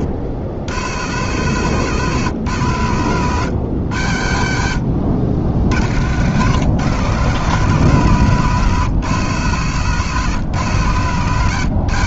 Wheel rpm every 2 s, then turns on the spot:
100, 120, 70, 140, 140, 130.
none